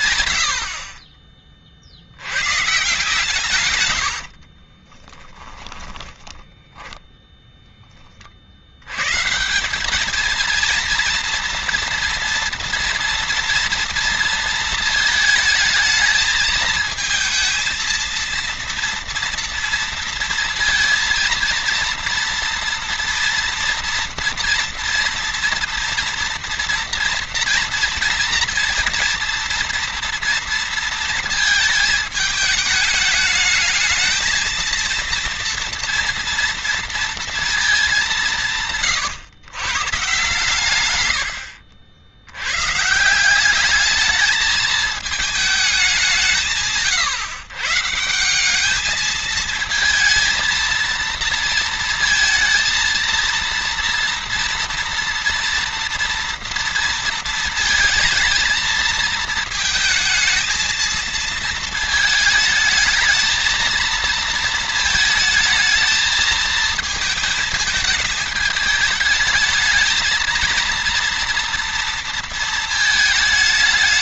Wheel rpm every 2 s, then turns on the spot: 90, 110, 50, 10, 50, 230, 230, 230, 220, 230, 230, 230, 230, 230, 230, 230, 210, 230, 230, 160, 130, 110, 220, 170, 200, 230, 230, 230, 230, 220, 220, 220, 230, 220, 210, 230, 220.
4-8